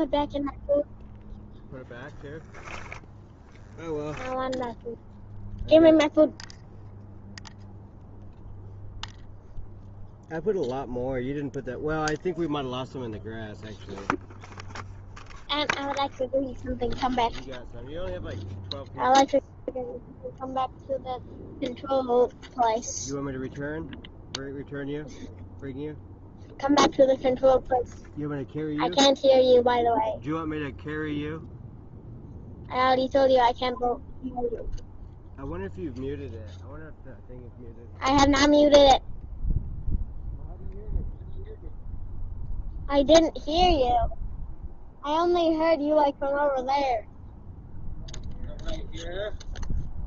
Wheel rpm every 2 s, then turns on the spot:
0, 0, 0, 0, 0, 0, 0, 0, 0, 0, 0, 0, 0, 0, 0, 0, 0, 0, 0, 0, 0, 0, 0, 0, 0.
none